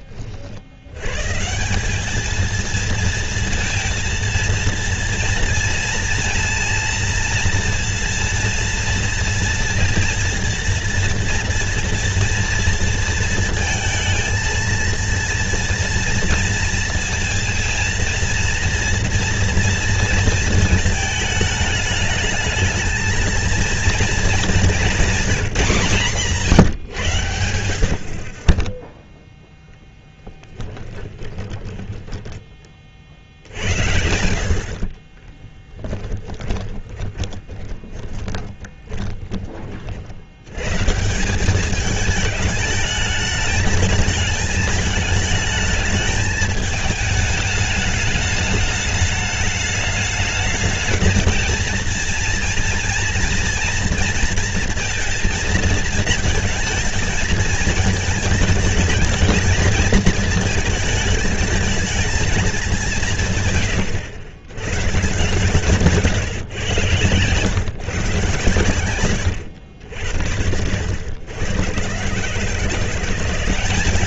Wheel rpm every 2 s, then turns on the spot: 70, 230, 230, 230, 230, 230, 230, 230, 230, 230, 230, 220, 220, 150, 20, 20, 30, 60, 20, 30, 130, 210, 220, 210, 210, 220, 230, 230, 230, 210, 220, 210, 120, 130, 120, 90, 160.
28-32 34-40